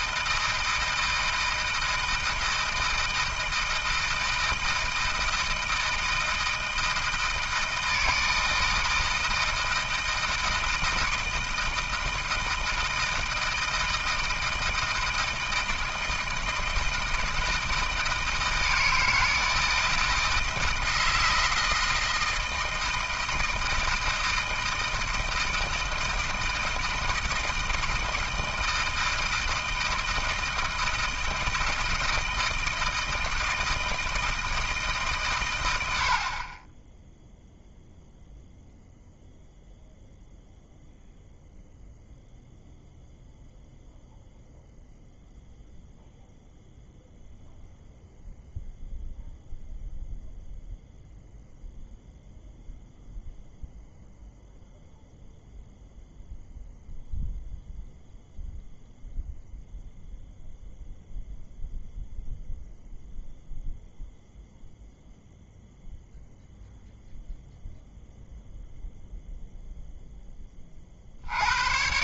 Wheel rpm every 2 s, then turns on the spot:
160, 160, 160, 160, 160, 160, 160, 160, 160, 160, 160, 160, 160, 160, 160, 160, 160, 160, 30, 0, 0, 0, 0, 0, 0, 0, 0, 0, 0, 0, 0, 0, 0, 0, 0, 30.
none